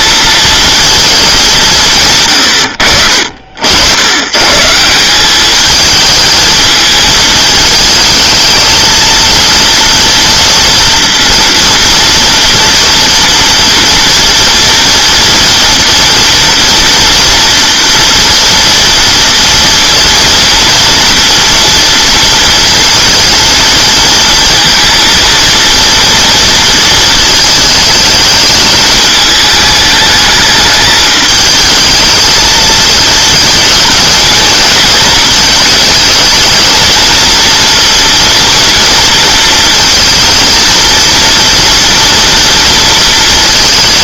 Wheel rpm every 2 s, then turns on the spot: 230, 90, 160, 220, 230, 230, 230, 240, 230, 230, 230, 230, 230, 230, 210, 210, 220, 230, 230, 230, 230, 230.
none